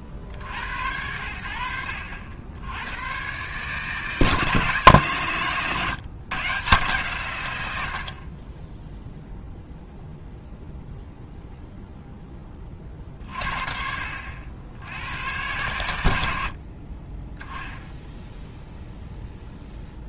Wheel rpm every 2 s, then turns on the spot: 30, 80, 140, 140, 40, 0, 30, 80, 50, 0.
none